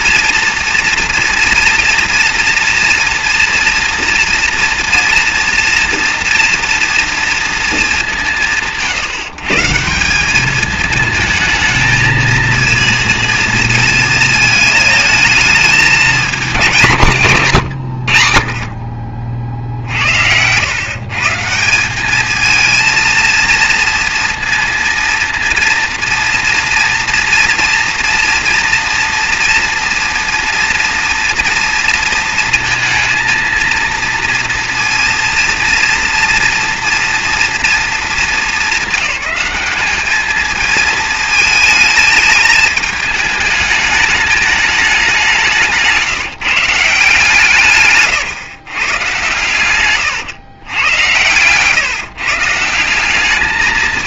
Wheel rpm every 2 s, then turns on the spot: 230, 230, 230, 230, 180, 210, 220, 220, 190, 60, 90, 220, 230, 230, 230, 230, 230, 230, 230, 220, 210, 220, 210, 170, 130, 110, 150.
50-52